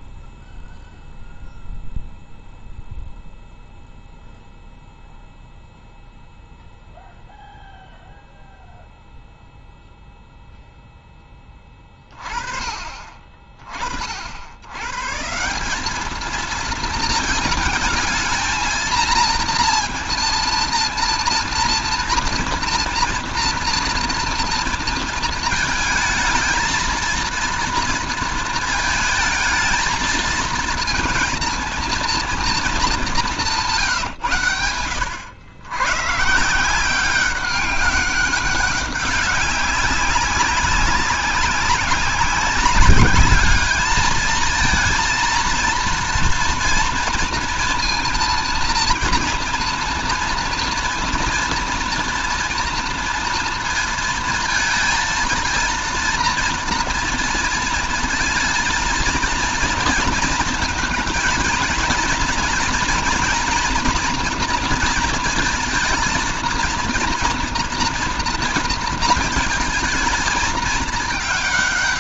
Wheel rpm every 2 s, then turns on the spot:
0, 0, 0, 0, 0, 0, 30, 90, 220, 220, 230, 230, 230, 230, 220, 230, 220, 130, 160, 200, 200, 200, 220, 230, 230, 230, 230, 230, 230, 230, 230, 230, 230, 230, 240, 220.
none